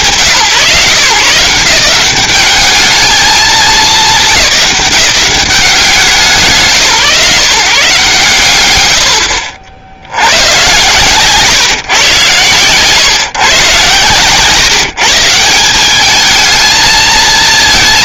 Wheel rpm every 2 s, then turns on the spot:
150, 200, 170, 140, 110, 120, 120, 150, 220.
none